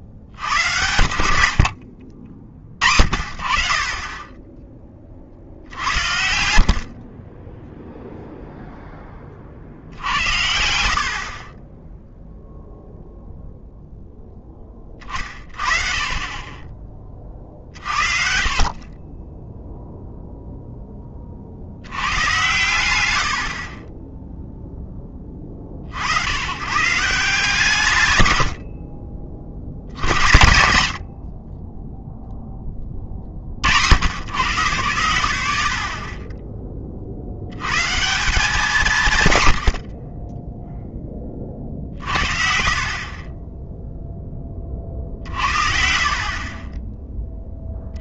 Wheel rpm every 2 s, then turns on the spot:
50, 50, 20, 60, 0, 70, 0, 20, 20, 50, 0, 120, 0, 120, 90, 70, 0, 110, 20, 180, 10, 60, 30, 30.
none